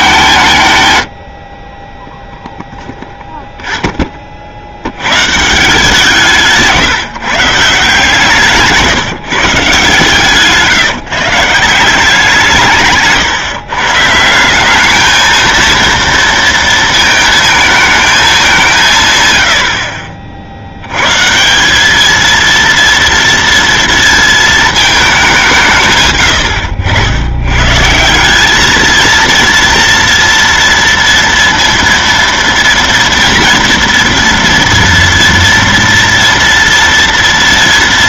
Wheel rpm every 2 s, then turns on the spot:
150, 0, 60, 160, 150, 150, 160, 180, 230, 180, 70, 230, 220, 100, 210, 230, 230, 230, 230.
8-10